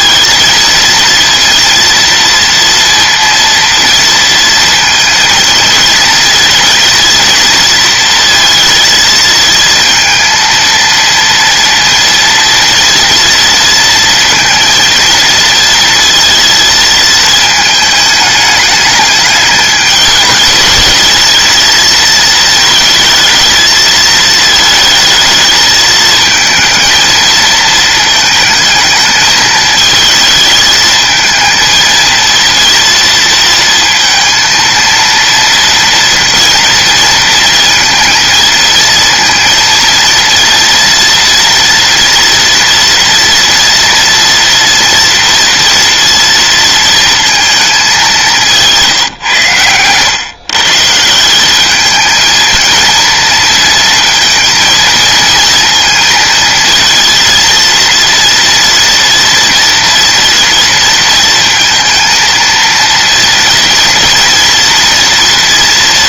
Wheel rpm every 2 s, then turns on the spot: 230, 230, 230, 220, 230, 230, 230, 230, 220, 210, 220, 220, 220, 220, 220, 220, 230, 230, 230, 230, 240, 230, 230, 230, 160, 150, 230, 230, 230, 240, 230, 230, 230.
none